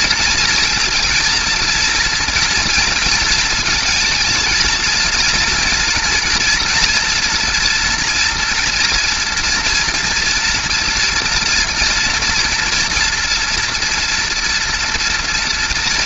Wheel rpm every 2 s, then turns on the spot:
230, 230, 230, 230, 230, 230, 240, 230.
none